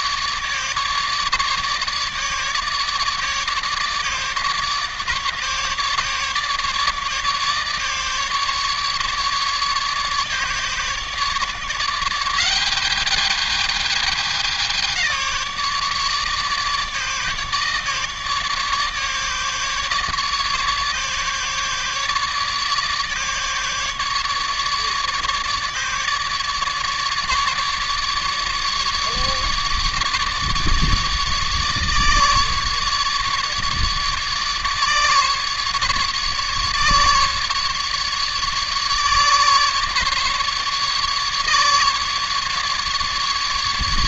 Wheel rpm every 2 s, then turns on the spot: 150, 150, 150, 150, 150, 150, 200, 190, 150, 150, 150, 150, 150, 150, 150, 150, 150, 150, 150, 150, 150, 150.
none